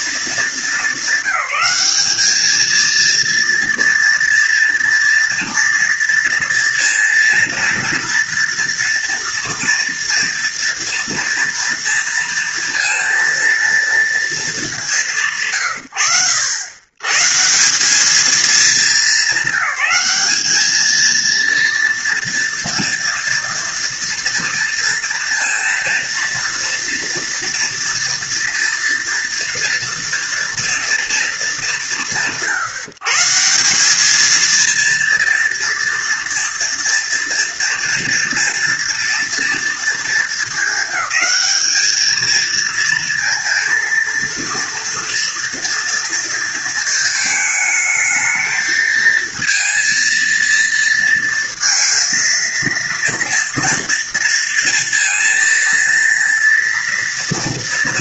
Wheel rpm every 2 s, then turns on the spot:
220, 210, 240, 230, 230, 230, 230, 220, 100, 210, 210, 230, 230, 230, 230, 230, 170, 220, 230, 230, 220, 220, 230, 230, 220, 230, 230, 230, 230.
none